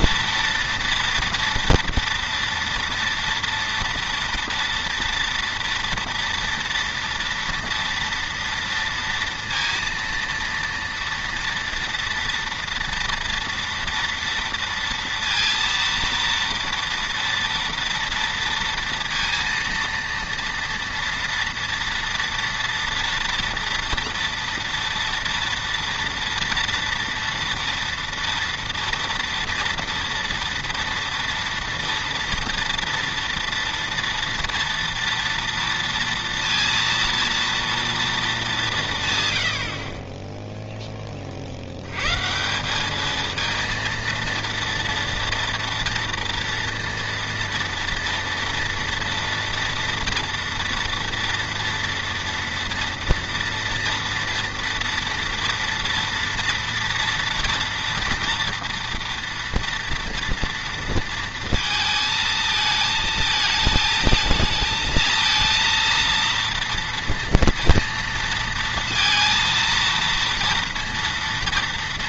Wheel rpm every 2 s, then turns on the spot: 230, 230, 230, 230, 230, 230, 230, 230, 230, 230, 230, 230, 230, 230, 230, 230, 230, 230, 230, 190, 10, 180, 230, 230, 230, 230, 230, 230, 230, 230, 230, 220, 220, 230, 230, 230.
none